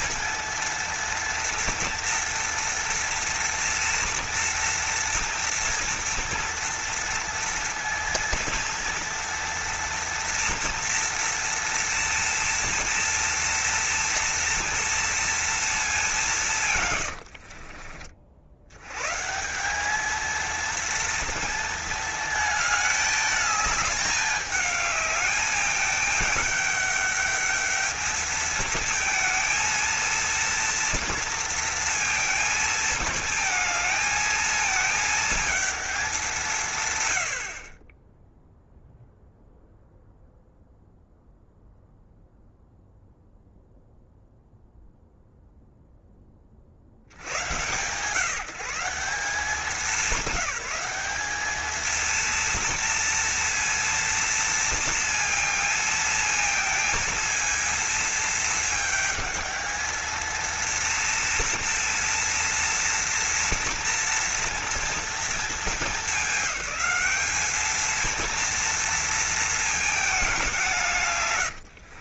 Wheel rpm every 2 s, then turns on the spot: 230, 230, 230, 230, 230, 230, 230, 230, 120, 110, 230, 210, 210, 210, 220, 230, 220, 220, 140, 0, 0, 0, 0, 70, 180, 200, 230, 230, 230, 220, 230, 230, 230, 210, 230, 140.
none